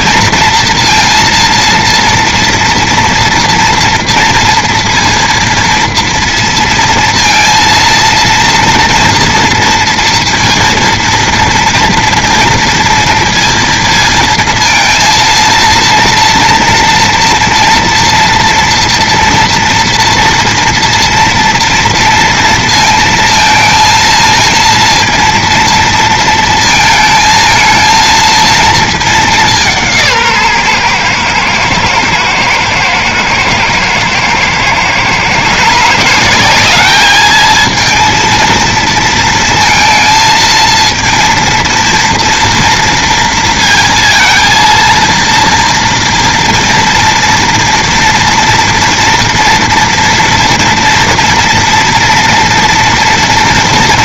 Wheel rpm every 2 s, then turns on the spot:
230, 230, 230, 230, 230, 230, 230, 230, 230, 240, 230, 230, 230, 230, 230, 140, 110, 120, 190, 230, 230, 230, 230, 230, 230, 230, 230.
none